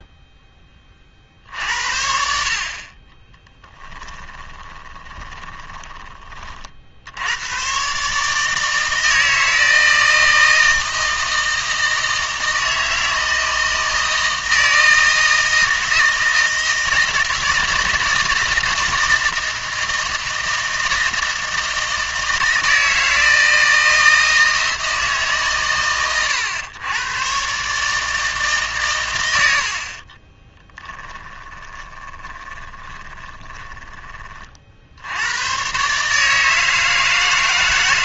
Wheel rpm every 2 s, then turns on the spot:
40, 30, 20, 60, 160, 160, 160, 160, 160, 160, 160, 160, 160, 100, 150, 10, 20, 70, 160.
4-6 30-34